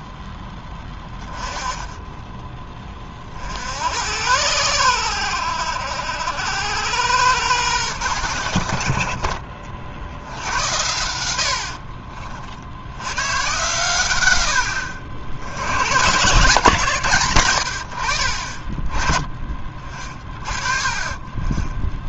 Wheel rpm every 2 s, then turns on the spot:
10, 20, 90, 90, 70, 90, 70, 80, 150, 40, 30.
14-16